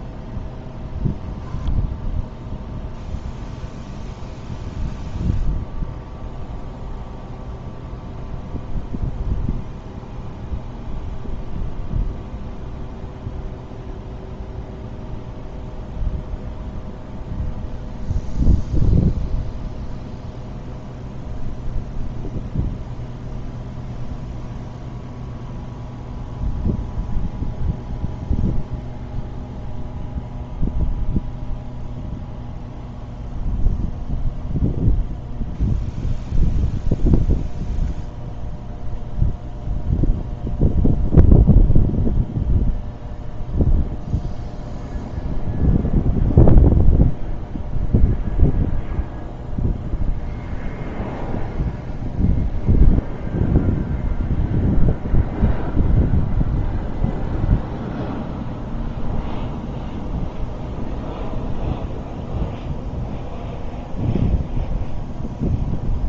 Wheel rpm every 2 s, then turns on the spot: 0, 0, 0, 0, 0, 0, 0, 0, 0, 0, 0, 0, 0, 0, 0, 0, 0, 0, 0, 0, 0, 0, 0, 0, 0, 0, 0, 0, 0, 0, 0, 0, 0.
none